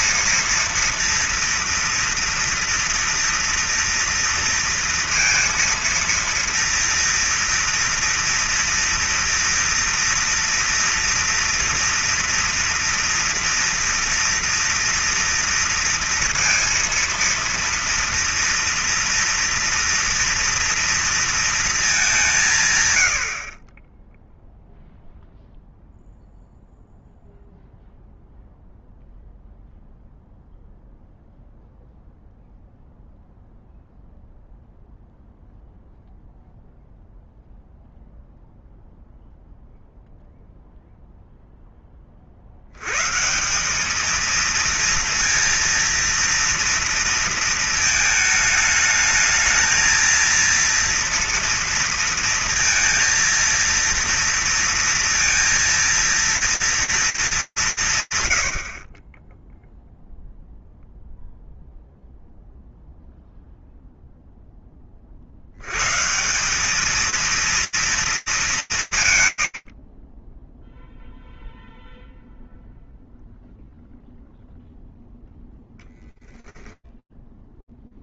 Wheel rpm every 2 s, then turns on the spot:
230, 240, 230, 230, 230, 240, 230, 230, 230, 230, 230, 220, 20, 0, 0, 0, 0, 0, 0, 0, 0, 20, 210, 230, 220, 220, 230, 230, 230, 120, 0, 0, 10, 190, 180, 10, 0, 0, 0.
none